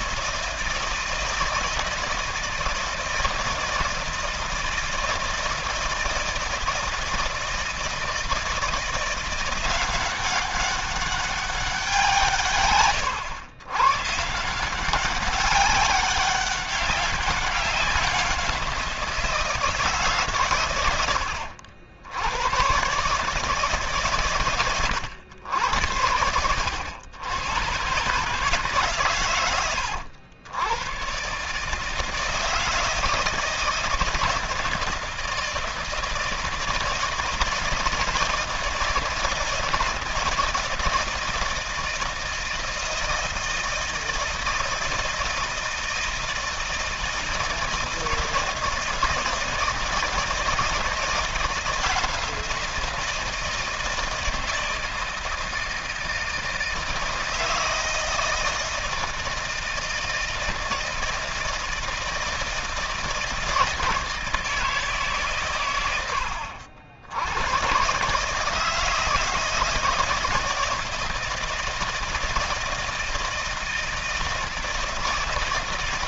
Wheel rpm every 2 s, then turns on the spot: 160, 160, 160, 160, 170, 200, 110, 190, 190, 170, 90, 130, 110, 100, 130, 120, 160, 160, 160, 160, 160, 160, 160, 160, 160, 170, 170, 160, 160, 160, 160, 160, 150, 100, 160, 160, 160, 160.
none